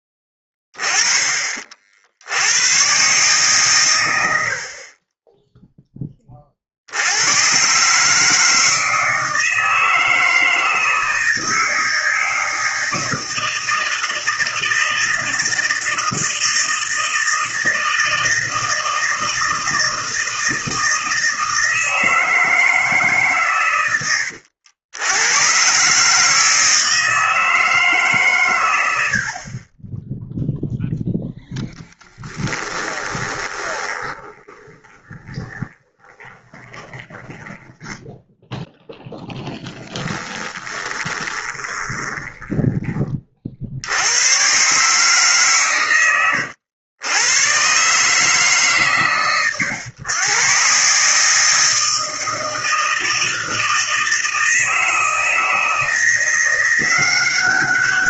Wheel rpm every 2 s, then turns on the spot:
10, 110, 60, 50, 160, 160, 160, 160, 160, 160, 160, 160, 80, 160, 100, 0, 10, 20, 20, 0, 20, 20, 130, 120, 150, 130, 160, 160, 180.
32-38 40-44